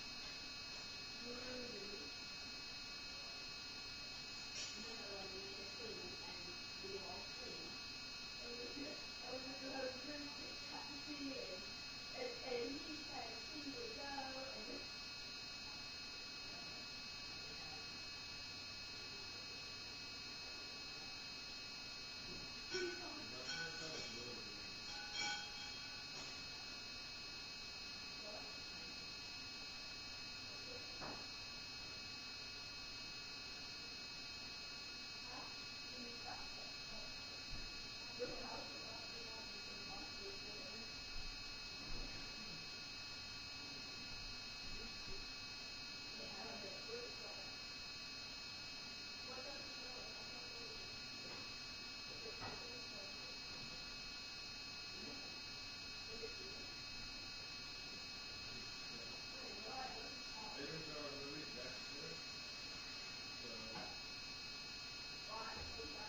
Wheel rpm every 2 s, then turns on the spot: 0, 0, 0, 0, 0, 0, 0, 0, 0, 0, 0, 0, 0, 0, 0, 0, 0, 0, 0, 0, 0, 0, 0, 0, 0, 0, 0, 0, 0, 0, 0, 0, 0.
none